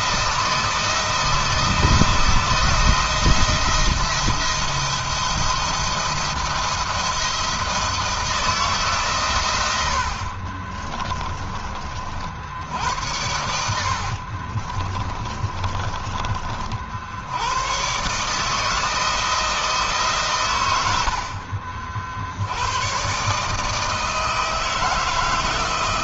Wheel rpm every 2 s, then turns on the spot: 170, 160, 170, 170, 140, 30, 90, 30, 70, 160, 80, 130, 160.
10-12 14-16